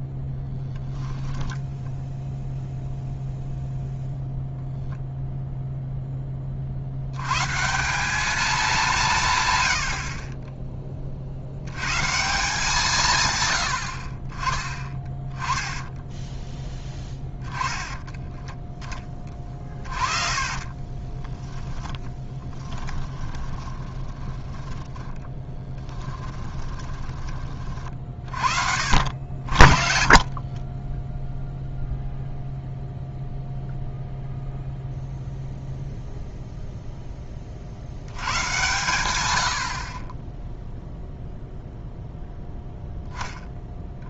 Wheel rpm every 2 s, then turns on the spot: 0, 0, 40, 190, 20, 170, 20, 10, 10, 20, 10, 20, 20, 50, 30, 0, 0, 0, 120, 0, 0, 0.
14-16 18-26 28-30